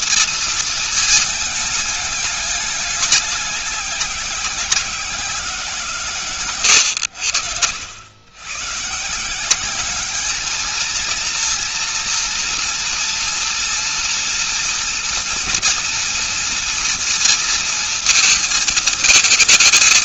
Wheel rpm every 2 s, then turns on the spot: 230, 210, 190, 120, 110, 220, 230, 240, 230, 230.
6-8